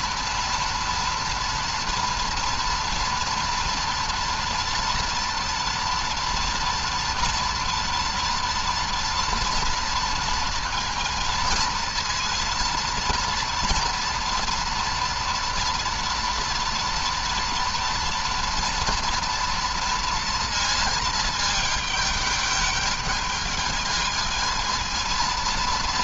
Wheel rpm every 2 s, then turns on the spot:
230, 230, 230, 230, 230, 230, 230, 230, 230, 240, 230, 210, 220.
none